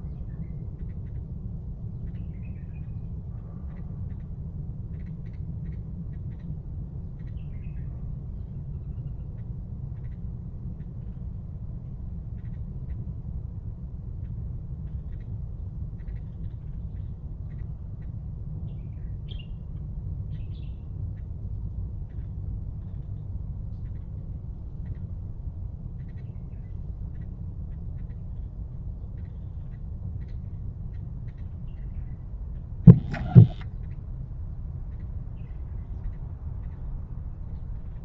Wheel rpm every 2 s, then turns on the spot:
0, 0, 0, 0, 0, 0, 0, 0, 0, 0, 0, 0, 0, 0, 0, 0, 0, 0, 0.
none